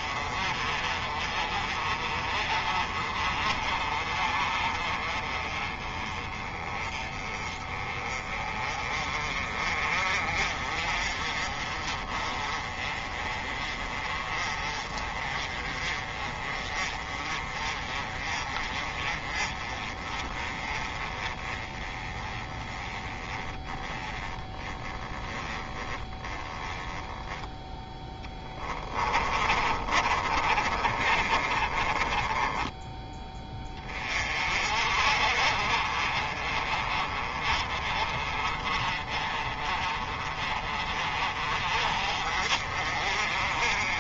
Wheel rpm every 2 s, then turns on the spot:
30, 40, 30, 20, 30, 40, 30, 30, 30, 30, 20, 20, 20, 20, 20, 40, 10, 50, 30, 30, 40, 40.
28-32